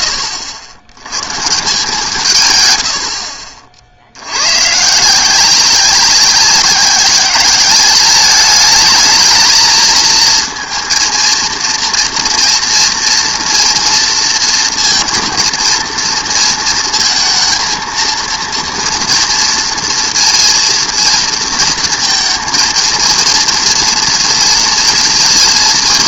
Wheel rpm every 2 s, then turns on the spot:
80, 120, 130, 190, 210, 230, 240, 230, 220, 230, 230, 230, 230.
none